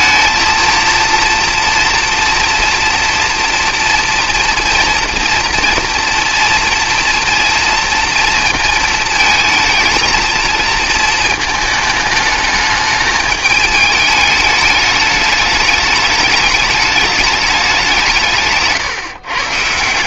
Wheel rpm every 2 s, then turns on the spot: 230, 230, 230, 230, 230, 220, 220, 210, 210, 150.
none